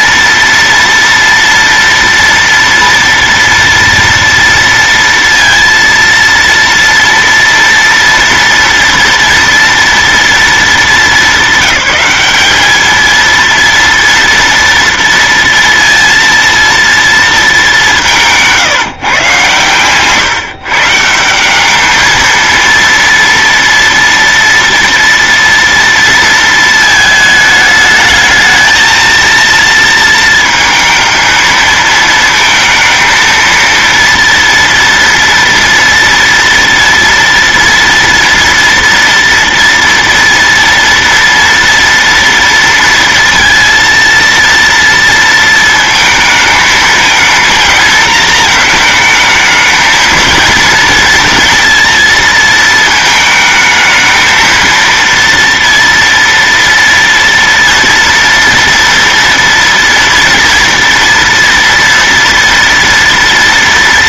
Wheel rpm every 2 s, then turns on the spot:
230, 230, 230, 230, 230, 220, 210, 230, 230, 160, 150, 230, 230, 230, 220, 220, 230, 230, 230, 230, 230, 230, 230, 220, 220, 230, 220, 230, 240, 230, 230, 230.
none